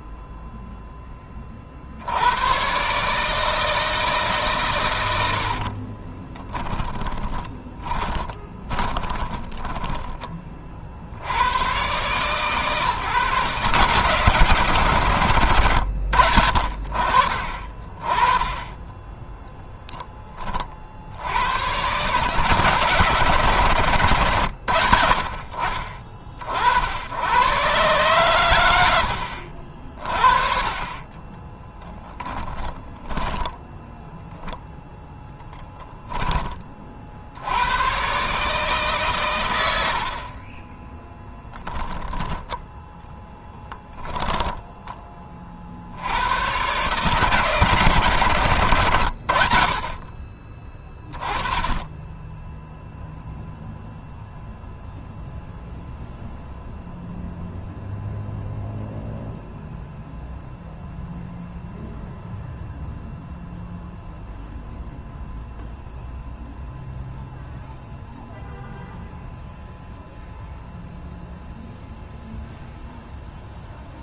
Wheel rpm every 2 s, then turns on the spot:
0, 100, 140, 20, 20, 30, 140, 130, 60, 20, 20, 150, 100, 50, 110, 30, 10, 0, 20, 140, 30, 20, 20, 100, 120, 30, 10, 0, 0, 0, 0, 0, 0, 0, 0, 0, 0.
6-10 32-34 40-42 44-46